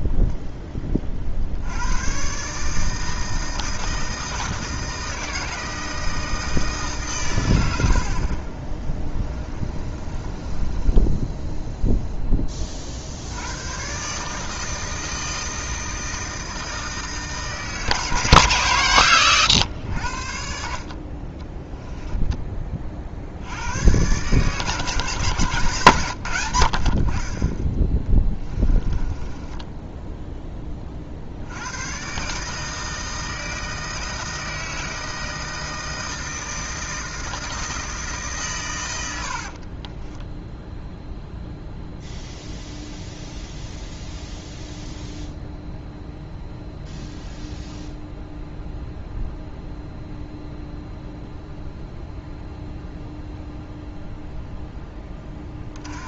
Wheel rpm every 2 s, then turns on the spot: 10, 140, 160, 160, 20, 10, 30, 160, 160, 140, 50, 30, 150, 80, 20, 20, 150, 160, 160, 120, 0, 0, 0, 0, 0, 0, 0, 10.
8-12 28-30